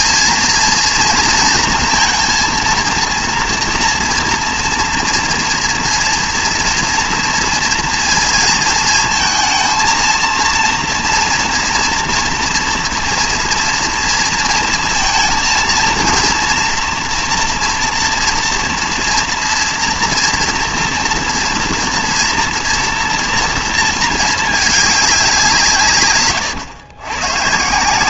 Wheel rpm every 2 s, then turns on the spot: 230, 230, 230, 230, 230, 230, 240, 230, 230, 230, 240, 240, 220, 120.
none